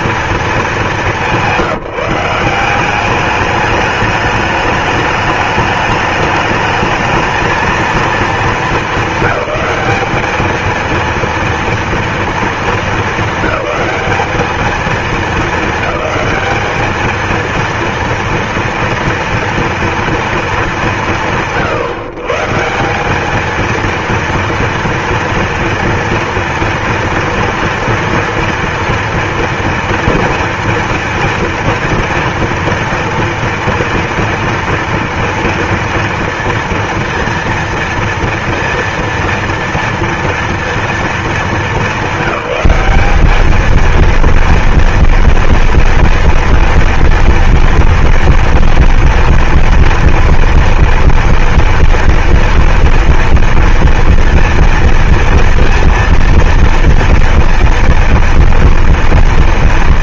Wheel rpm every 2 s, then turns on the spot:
210, 190, 210, 220, 200, 230, 220, 210, 210, 230, 170, 190, 230, 240, 240, 230, 230, 230, 230, 230, 230, 200, 230, 230, 230, 230, 230, 230, 230, 230.
none